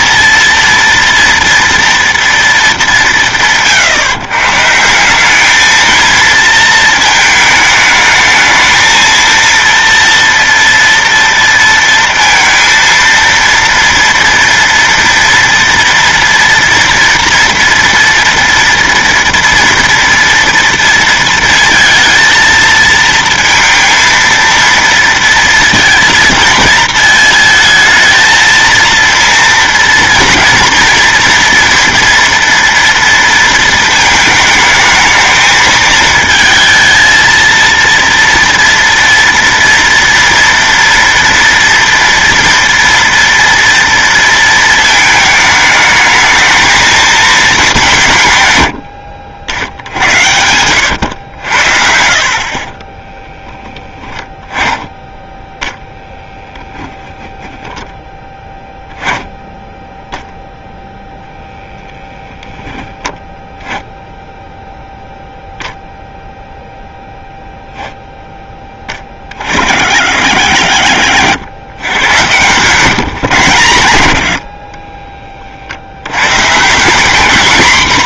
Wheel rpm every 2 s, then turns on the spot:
230, 170, 140, 230, 220, 230, 230, 230, 230, 240, 230, 230, 230, 230, 230, 230, 230, 220, 220, 230, 230, 230, 230, 220, 130, 90, 50, 10, 10, 10, 0, 0, 0, 0, 10, 80, 140, 60, 140.
50-54 74-76